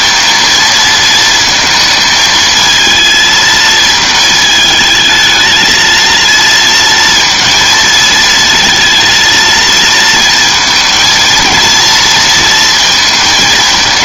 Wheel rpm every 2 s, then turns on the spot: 230, 220, 220, 230, 230, 230, 220.
none